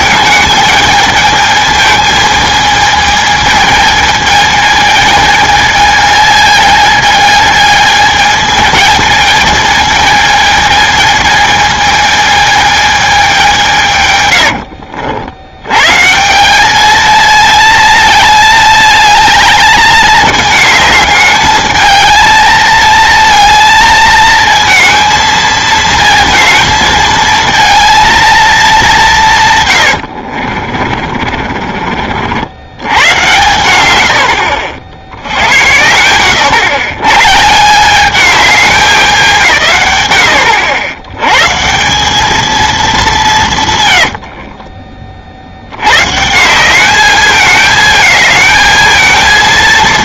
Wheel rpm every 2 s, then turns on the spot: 210, 220, 220, 220, 220, 220, 220, 80, 200, 220, 210, 220, 220, 220, 220, 50, 90, 60, 100, 200, 70, 220, 40, 180, 220.
14-16 30-32